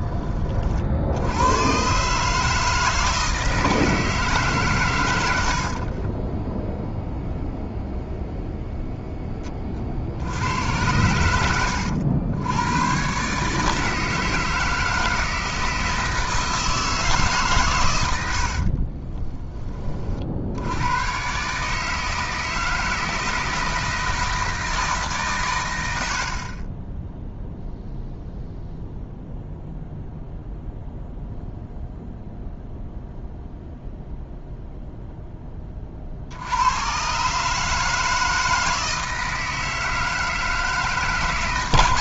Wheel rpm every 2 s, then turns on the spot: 60, 160, 120, 0, 0, 100, 110, 160, 160, 30, 100, 160, 160, 10, 0, 0, 0, 0, 110, 160, 150.
18-20